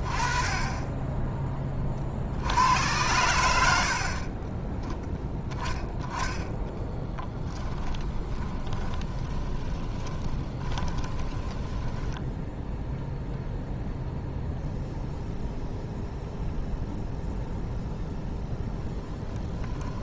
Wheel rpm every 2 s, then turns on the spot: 10, 80, 10, 10, 20, 20, 0, 0, 0, 10.
8-12